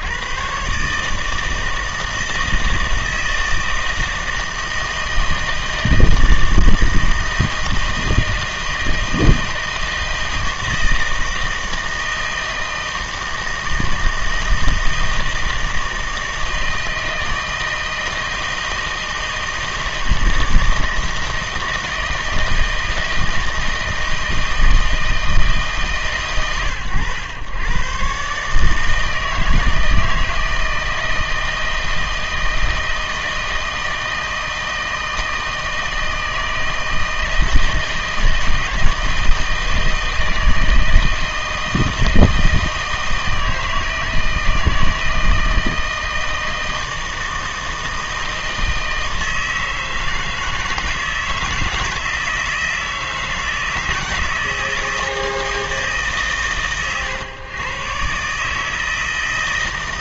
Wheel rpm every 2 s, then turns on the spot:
130, 160, 160, 160, 160, 160, 160, 160, 160, 160, 160, 160, 160, 110, 150, 160, 160, 160, 160, 160, 160, 160, 160, 160, 160, 160, 160, 160, 130, 160.
none